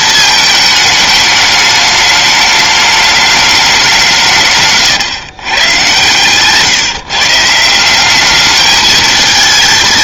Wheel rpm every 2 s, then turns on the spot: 220, 210, 140, 140, 210.
4-6